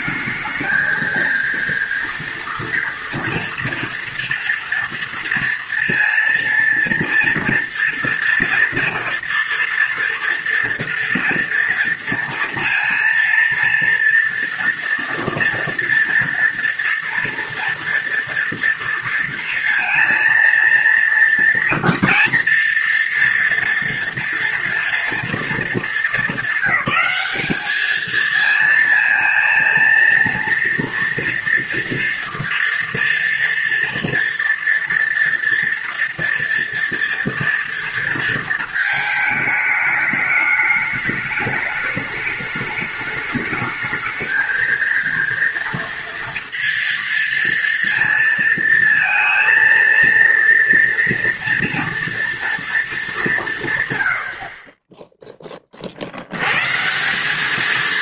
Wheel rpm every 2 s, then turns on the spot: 220, 230, 230, 230, 230, 230, 230, 230, 230, 230, 230, 230, 230, 220, 220, 230, 230, 240, 230, 220, 210, 210, 220, 230, 230, 230, 230, 40, 120.
none